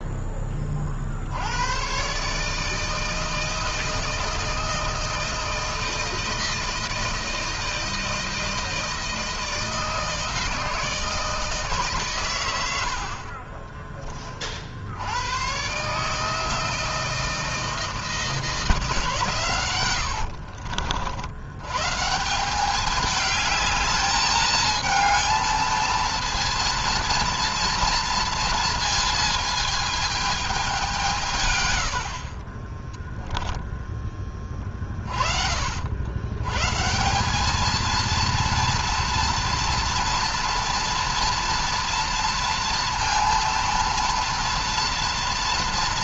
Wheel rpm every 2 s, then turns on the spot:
30, 150, 160, 160, 160, 160, 100, 50, 160, 160, 70, 190, 220, 230, 220, 200, 30, 20, 130, 230, 230, 230, 230.
12-14 20-22